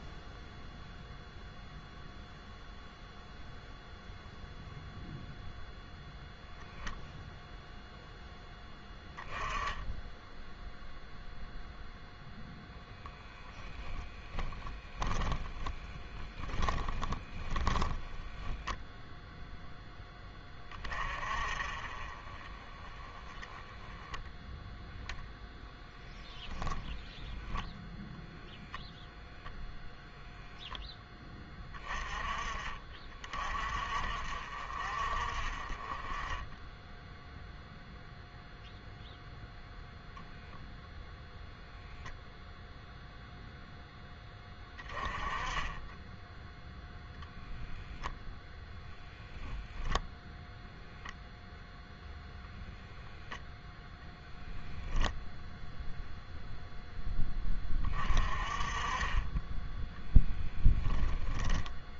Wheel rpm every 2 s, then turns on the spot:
0, 0, 0, 0, 10, 0, 10, 20, 10, 0, 20, 20, 0, 10, 0, 0, 30, 50, 10, 0, 0, 0, 10, 0, 0, 0, 0, 0, 0, 30, 10.
14-18